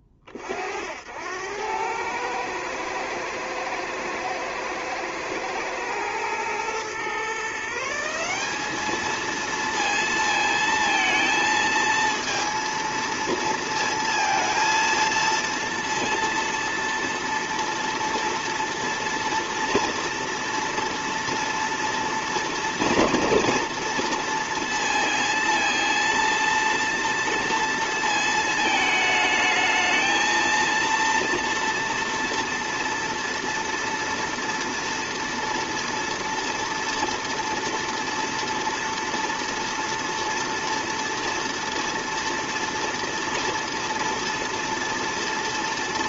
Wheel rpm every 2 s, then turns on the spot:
30, 110, 120, 120, 190, 230, 230, 230, 230, 240, 230, 230, 230, 230, 220, 230, 230, 230, 230, 230, 230, 230, 230.
none